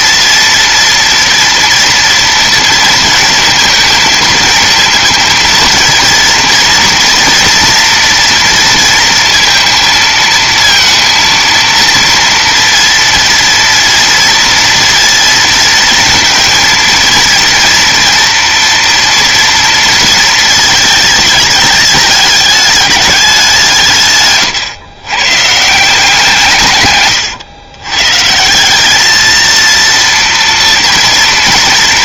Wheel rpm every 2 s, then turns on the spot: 230, 230, 230, 230, 230, 230, 230, 240, 230, 230, 230, 210, 130, 160, 180, 230.
none